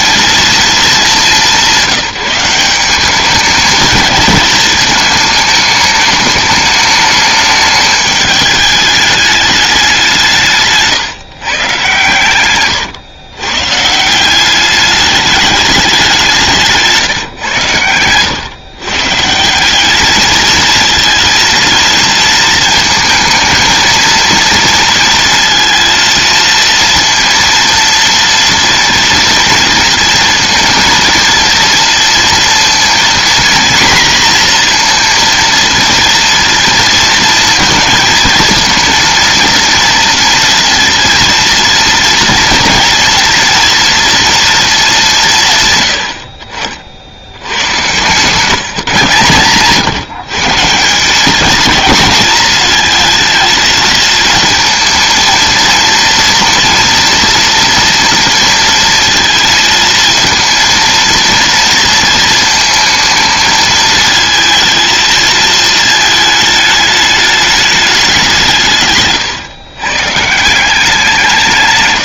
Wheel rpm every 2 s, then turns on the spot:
220, 190, 220, 210, 210, 150, 120, 200, 170, 130, 220, 230, 230, 230, 230, 230, 230, 240, 230, 230, 230, 230, 200, 70, 150, 160, 220, 230, 230, 230, 230, 220, 230, 220, 170, 170.
12-14